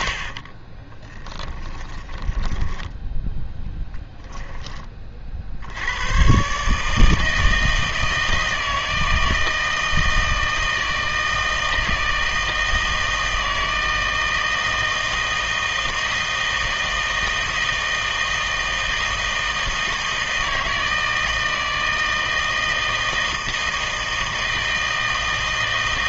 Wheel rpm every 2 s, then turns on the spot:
40, 10, 10, 150, 160, 160, 160, 160, 160, 160, 160, 160, 160.
0-4